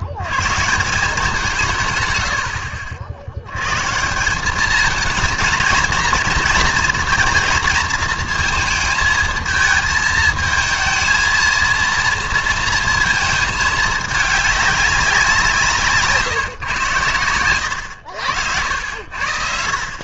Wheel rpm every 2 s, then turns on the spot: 140, 60, 200, 230, 220, 220, 230, 200, 130, 80.
none